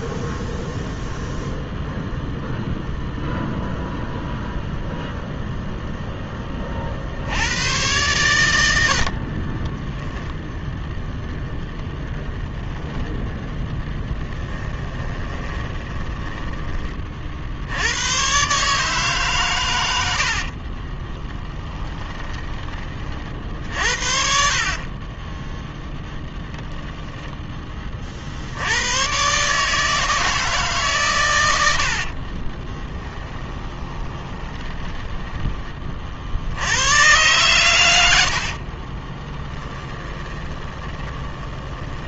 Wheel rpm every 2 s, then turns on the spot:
0, 0, 0, 50, 100, 0, 0, 20, 30, 150, 30, 40, 30, 10, 100, 130, 10, 20, 100, 20, 20.
14-16 20-22 24-26 32-36 38-42